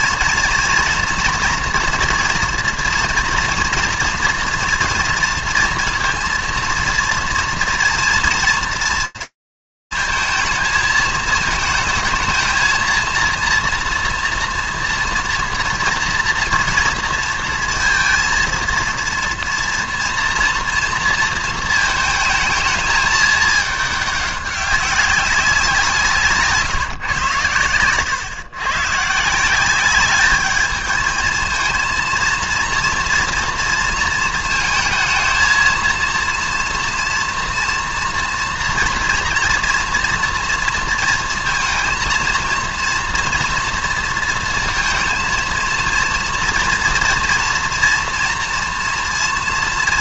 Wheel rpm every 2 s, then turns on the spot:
230, 240, 230, 230, 230, 220, 230, 230, 230, 230, 220, 210, 190, 120, 160, 220, 230, 230, 230, 230, 230, 230, 230, 230, 230.
none